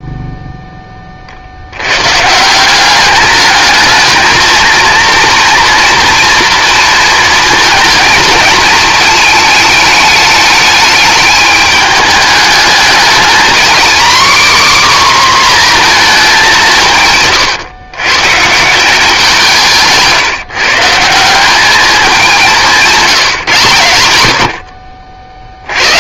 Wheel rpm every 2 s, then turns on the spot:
30, 200, 230, 230, 220, 210, 220, 260, 130, 170, 170, 190, 50.
16-18